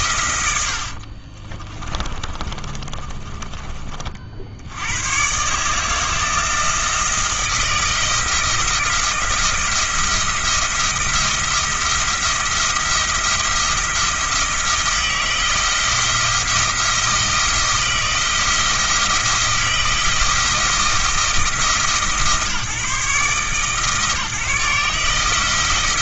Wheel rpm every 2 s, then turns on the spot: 60, 20, 90, 170, 170, 170, 170, 170, 170, 170, 160, 150, 150.
0-4